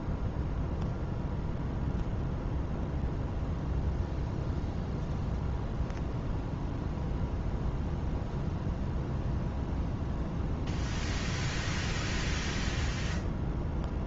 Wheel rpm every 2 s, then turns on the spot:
0, 0, 0, 0, 0, 0, 0.
none